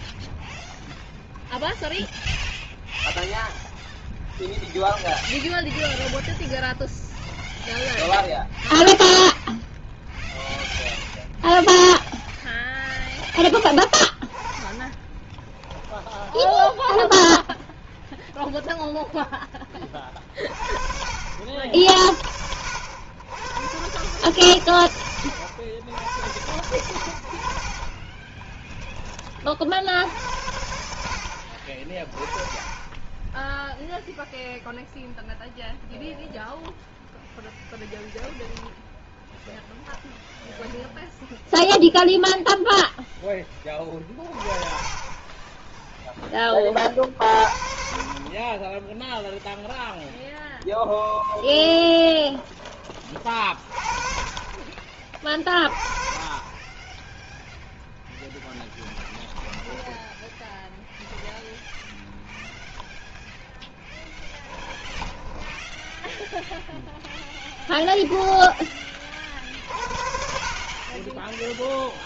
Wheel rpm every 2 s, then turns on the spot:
0, 0, 0, 0, 0, 0, 0, 10, 0, 10, 40, 90, 110, 90, 20, 70, 20, 0, 0, 0, 0, 0, 30, 30, 10, 0, 10, 30, 20, 10, 0, 10, 10, 0, 20, 30.
14-16 64-66